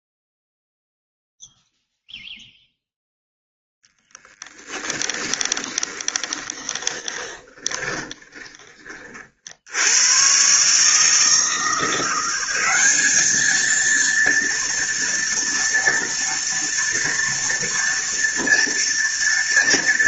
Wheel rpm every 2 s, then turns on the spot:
0, 0, 20, 20, 30, 130, 190, 230, 230, 230.
4-8